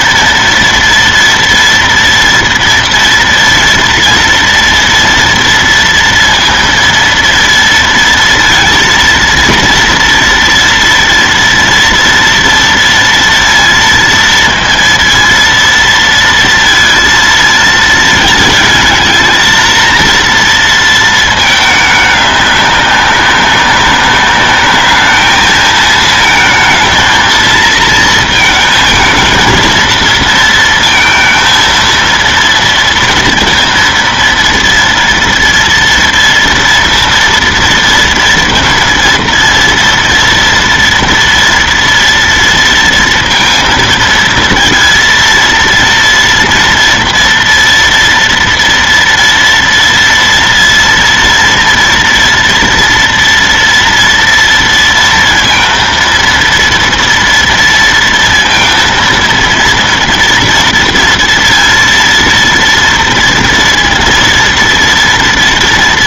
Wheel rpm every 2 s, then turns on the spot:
230, 230, 230, 230, 230, 230, 230, 230, 230, 210, 230, 200, 210, 230, 220, 230, 230, 230, 230, 230, 230, 230, 230, 230, 230, 230, 230, 230, 230, 230, 230, 230, 230.
none